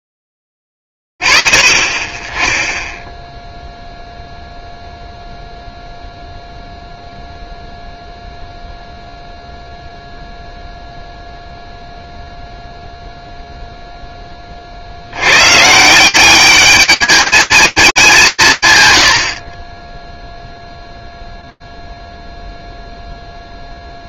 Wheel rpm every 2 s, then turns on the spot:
0, 30, 0, 0, 0, 0, 0, 50, 210, 120, 0, 0.
none